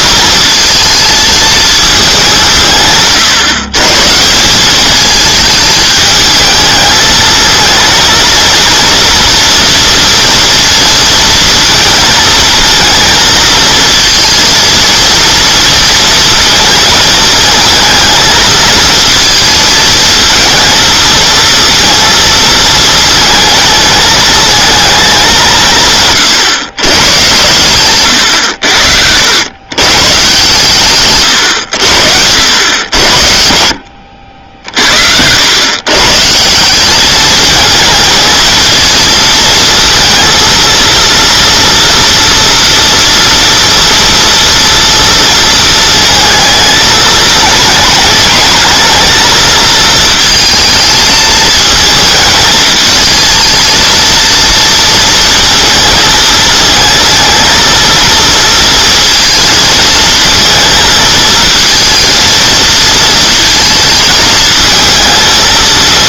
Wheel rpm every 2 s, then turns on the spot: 230, 150, 200, 220, 230, 230, 230, 230, 230, 230, 230, 230, 220, 130, 80, 140, 90, 60, 180, 230, 230, 240, 230, 220, 220, 220, 220, 230, 230, 230, 220, 230, 220.
none